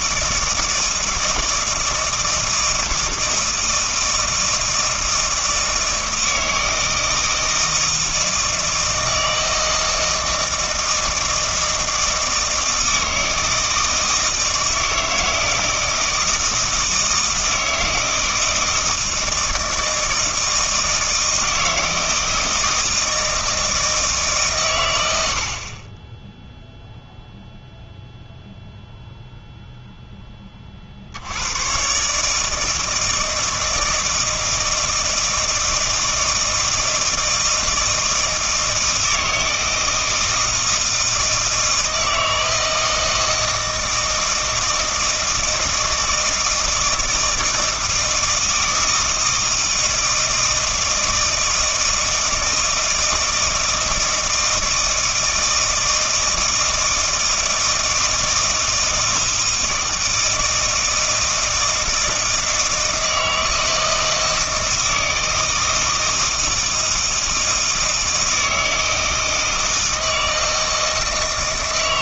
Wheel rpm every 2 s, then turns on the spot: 160, 160, 160, 160, 160, 160, 160, 160, 160, 160, 160, 160, 120, 0, 0, 40, 160, 160, 160, 160, 160, 160, 160, 160, 160, 160, 160, 160, 160, 160, 160, 160, 160, 160, 160, 160.
none